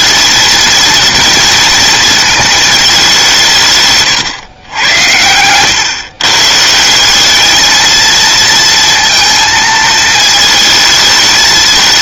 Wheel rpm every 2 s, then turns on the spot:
230, 230, 140, 130, 230, 220.
none